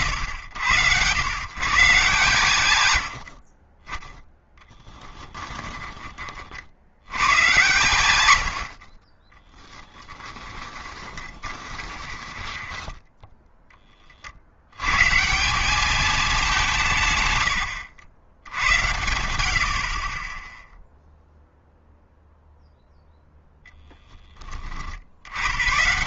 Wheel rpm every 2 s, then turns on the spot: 100, 110, 10, 80, 50, 20, 10, 110, 160, 90, 0, 0, 40.
4-6 10-14